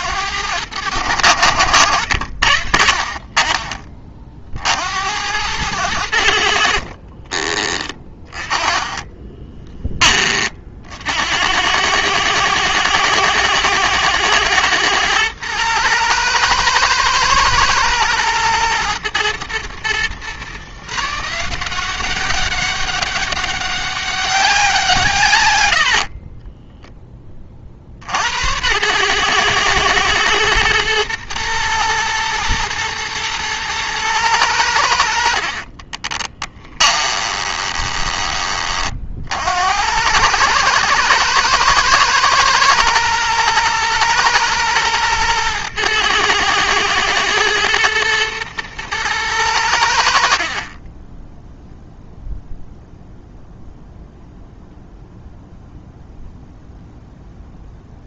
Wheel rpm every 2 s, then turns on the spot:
90, 50, 70, 50, 20, 60, 110, 110, 120, 110, 150, 200, 170, 10, 110, 110, 120, 80, 20, 40, 110, 110, 120, 110, 110, 20, 0, 0, 0.
6-10 36-38